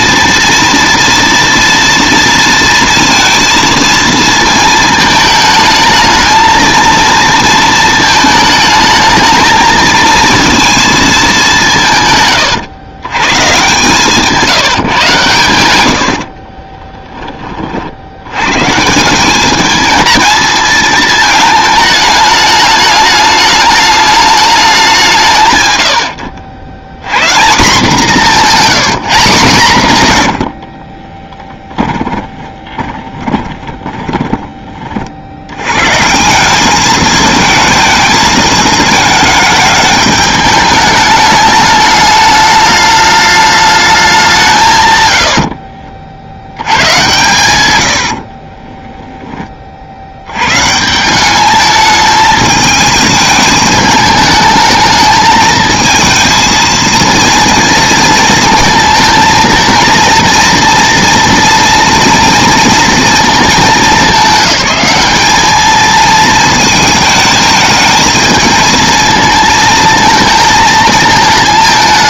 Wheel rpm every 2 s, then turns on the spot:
230, 230, 230, 230, 220, 230, 120, 170, 30, 130, 220, 210, 200, 90, 200, 60, 20, 30, 200, 220, 210, 210, 130, 100, 20, 130, 220, 220, 230, 230, 230, 230, 200, 220, 220, 220.
16-18 30-34 48-50